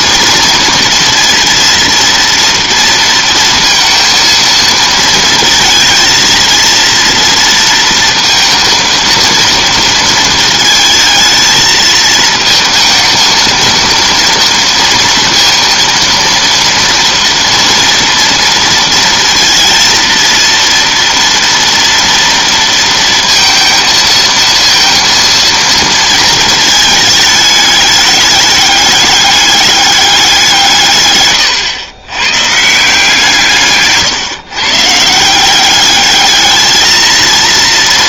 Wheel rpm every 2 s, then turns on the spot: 230, 230, 230, 230, 230, 220, 220, 230, 230, 230, 230, 230, 230, 220, 210, 160, 150, 140, 220.
none